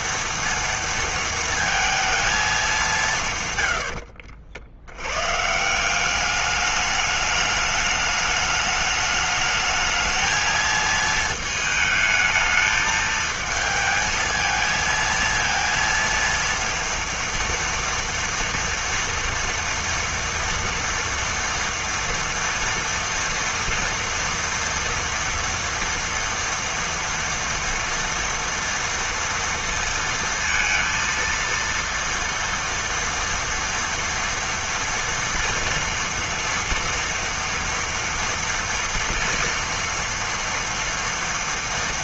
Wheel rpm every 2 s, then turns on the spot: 230, 220, 70, 210, 210, 220, 220, 230, 230, 230, 240, 230, 230, 230, 240, 230, 230, 230, 230, 230, 230.
none